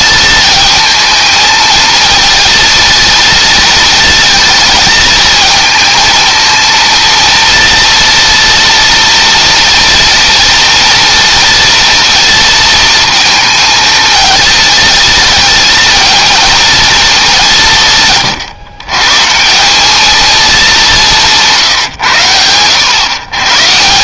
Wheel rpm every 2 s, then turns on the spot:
220, 220, 220, 230, 230, 230, 220, 220, 220, 130, 190, 100.
none